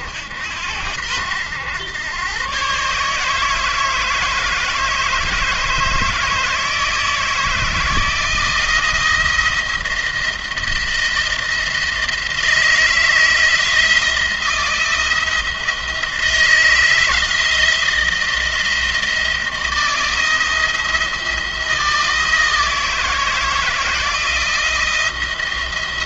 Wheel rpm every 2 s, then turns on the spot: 80, 130, 160, 160, 160, 170, 160, 170, 160, 170, 170, 160, 170.
none